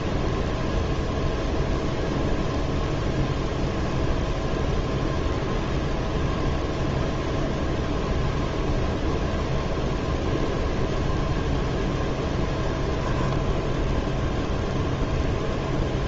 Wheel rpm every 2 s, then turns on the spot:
0, 0, 0, 0, 0, 0, 0, 0.
none